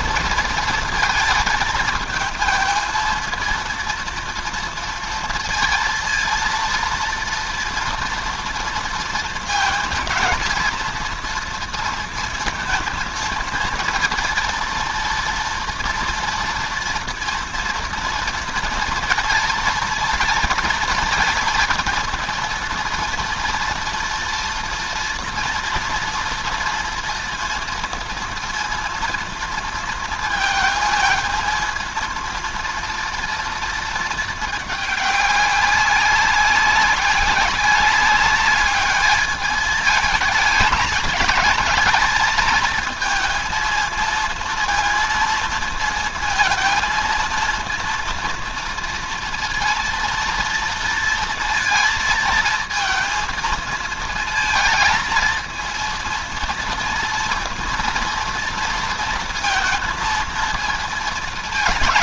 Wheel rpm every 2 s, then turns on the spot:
230, 220, 230, 230, 230, 230, 230, 230, 230, 230, 230, 230, 230, 230, 230, 220, 230, 210, 190, 210, 210, 220, 230, 230, 230, 230, 220, 220, 230, 230, 230.
none